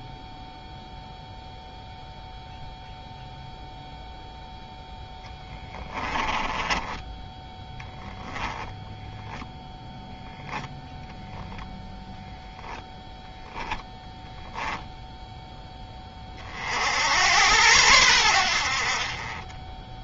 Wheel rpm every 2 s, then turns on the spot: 0, 0, 0, 10, 10, 0, 0, 0, 70, 50.
none